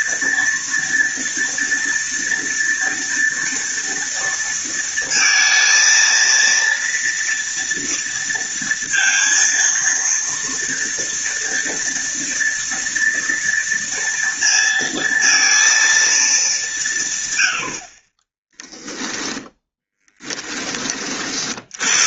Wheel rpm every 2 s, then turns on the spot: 240, 240, 230, 230, 230, 230, 230, 230, 170, 10, 30.
18-20